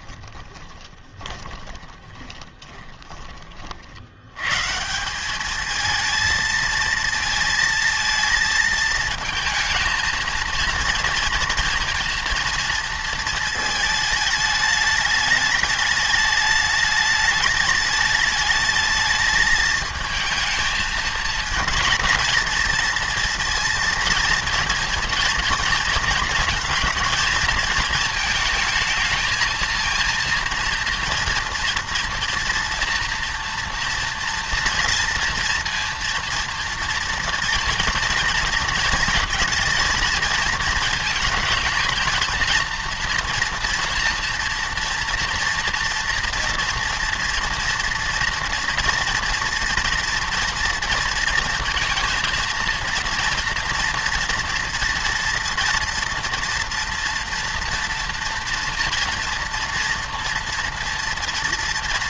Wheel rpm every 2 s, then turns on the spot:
20, 20, 140, 220, 220, 230, 230, 210, 210, 220, 220, 230, 230, 230, 220, 230, 240, 230, 230, 230, 230, 230, 230, 230, 230, 230, 230, 230, 240, 230, 230.
0-4